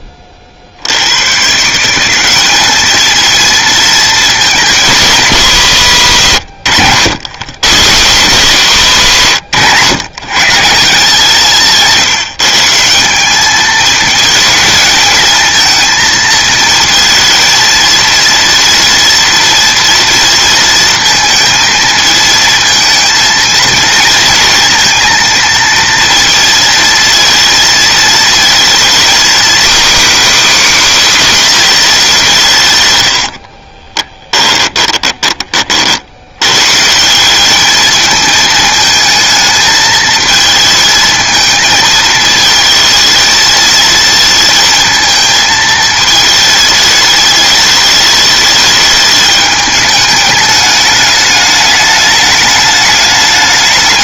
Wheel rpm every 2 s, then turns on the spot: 0, 110, 220, 180, 110, 120, 170, 190, 220, 220, 230, 230, 230, 230, 230, 250, 270, 80, 30, 190, 220, 220, 220, 220, 220, 210, 210.
34-36